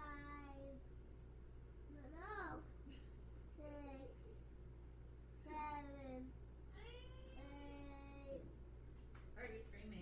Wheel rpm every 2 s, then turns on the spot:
0, 0, 0, 0, 0.
none